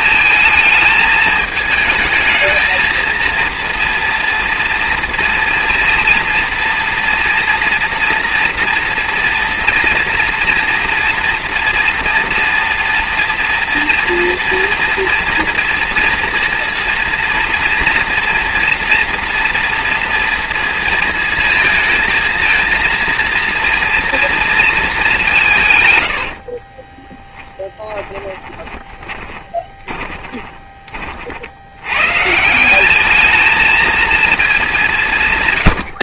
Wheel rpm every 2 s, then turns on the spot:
220, 230, 230, 230, 230, 230, 230, 230, 230, 230, 220, 230, 200, 10, 20, 40, 210, 160.
26-30